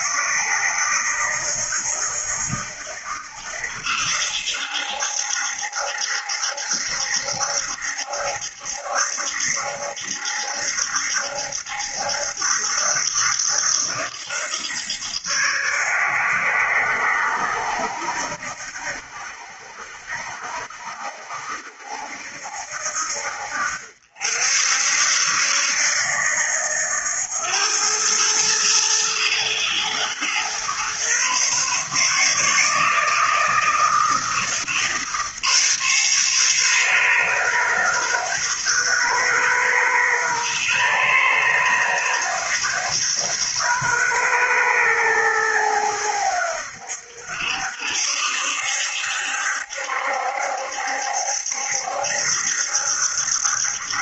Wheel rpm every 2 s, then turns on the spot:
70, 80, 70, 70, 70, 70, 80, 80, 70, 70, 70, 70, 70, 80, 110, 120, 150, 150, 130, 130, 130, 130, 120, 80, 70, 70, 70.
none